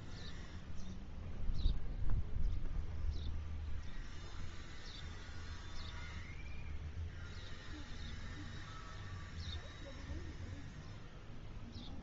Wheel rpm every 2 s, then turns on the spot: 0, 0, 0, 0, 0, 0.
none